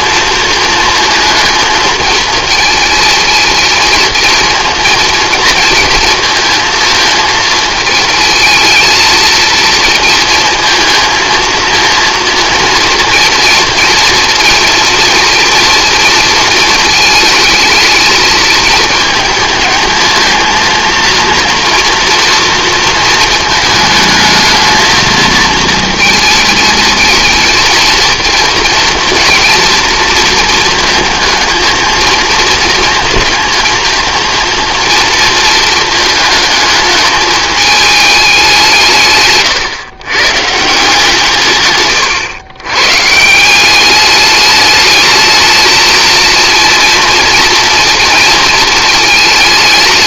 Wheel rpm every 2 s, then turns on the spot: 220, 220, 230, 220, 220, 230, 230, 230, 230, 220, 230, 230, 220, 220, 240, 230, 230, 230, 220, 170, 150, 120, 210, 230, 220.
none